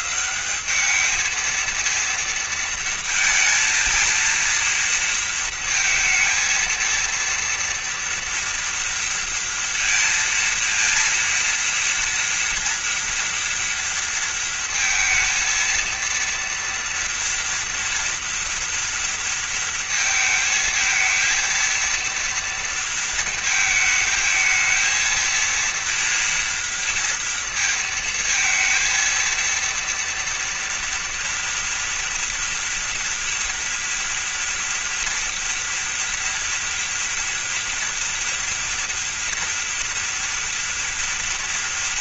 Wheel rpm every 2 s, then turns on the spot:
210, 230, 230, 230, 230, 230, 230, 230, 230, 230, 220, 230, 230, 230, 230, 240, 230, 230, 230, 230, 230.
none